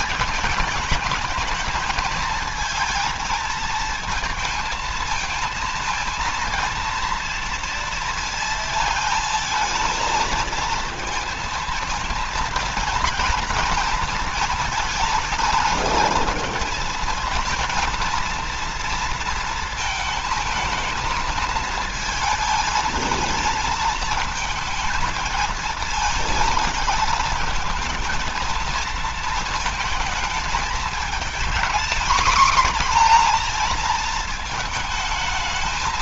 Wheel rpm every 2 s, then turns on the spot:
220, 230, 230, 230, 220, 220, 230, 230, 230, 230, 220, 220, 230, 220, 220, 220, 230, 220.
none